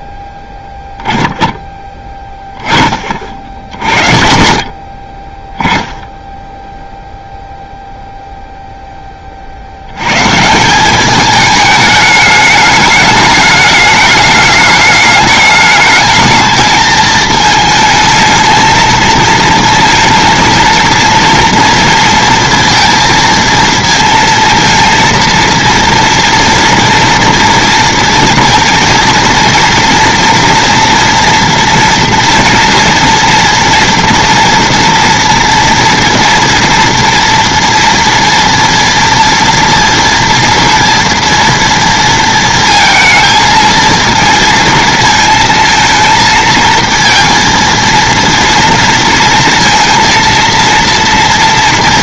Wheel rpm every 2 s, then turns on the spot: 10, 10, 50, 0, 0, 160, 210, 210, 220, 220, 230, 230, 230, 230, 230, 240, 230, 230, 240, 230, 230, 230, 230, 230, 230, 230.
none